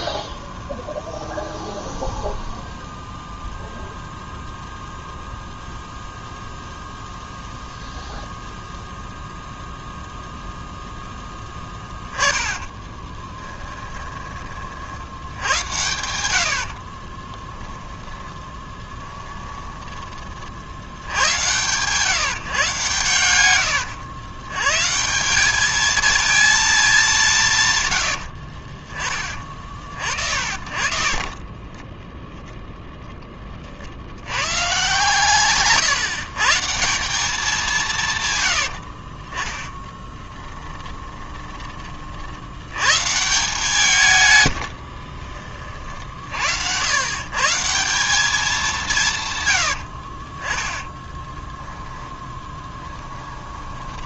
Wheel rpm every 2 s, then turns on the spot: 0, 0, 0, 0, 0, 0, 10, 30, 70, 20, 60, 130, 120, 220, 40, 50, 10, 120, 160, 80, 10, 90, 90, 80, 200, 20, 10.
12-14 18-20 40-42 52-54